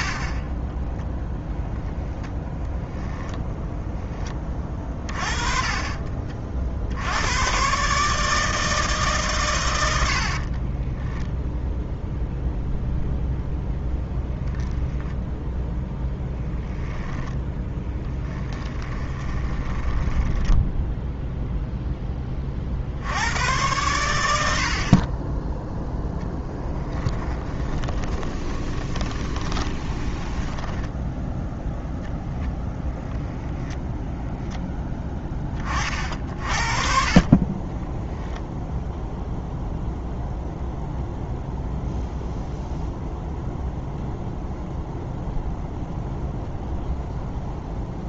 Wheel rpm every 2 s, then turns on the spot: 20, 10, 30, 90, 140, 0, 0, 0, 10, 20, 0, 80, 30, 20, 20, 10, 10, 10, 40, 0, 0, 0, 0, 0.
0-6 16-20 26-30